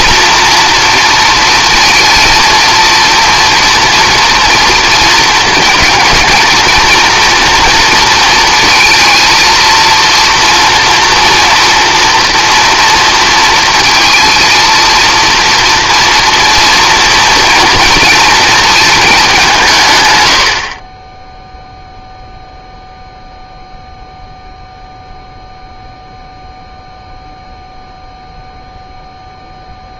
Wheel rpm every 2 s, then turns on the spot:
240, 230, 230, 230, 230, 240, 240, 230, 240, 220, 30, 0, 0, 0, 0.
none